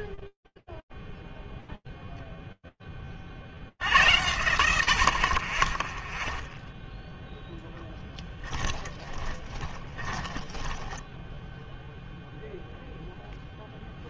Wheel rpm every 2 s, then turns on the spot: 20, 0, 100, 0, 10, 20, 0.
8-12